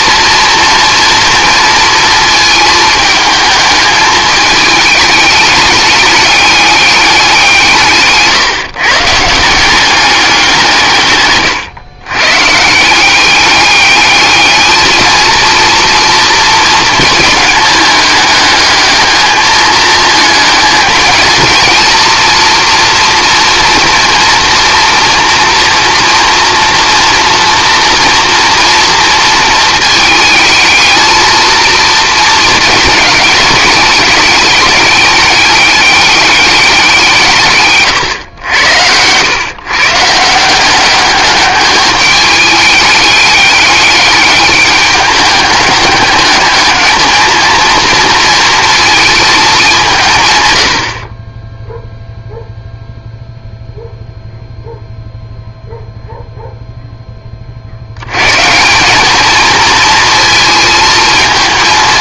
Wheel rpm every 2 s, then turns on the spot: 230, 220, 210, 200, 150, 170, 140, 220, 220, 210, 210, 230, 230, 230, 230, 220, 210, 210, 200, 100, 180, 200, 210, 210, 230, 100, 0, 0, 0, 170, 220.
38-40